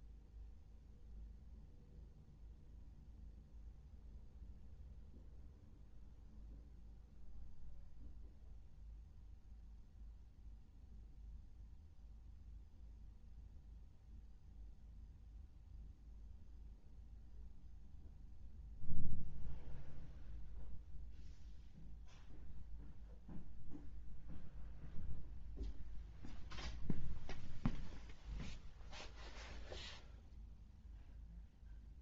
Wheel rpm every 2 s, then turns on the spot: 0, 0, 0, 0, 0, 0, 0, 0, 0, 0, 0, 0, 0, 0, 0, 0.
none